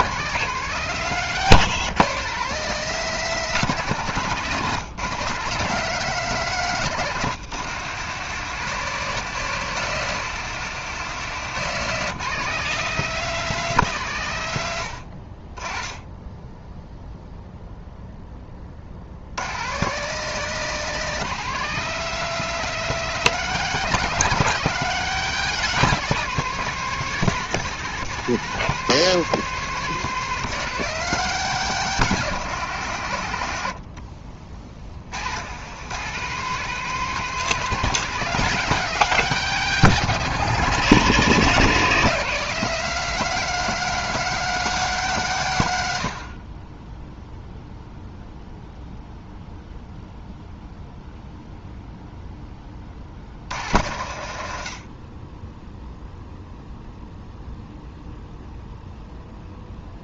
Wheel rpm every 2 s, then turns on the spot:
190, 180, 170, 160, 170, 170, 190, 110, 10, 40, 190, 200, 190, 190, 190, 180, 140, 60, 180, 190, 160, 180, 190, 20, 0, 0, 20, 60, 0, 0.
none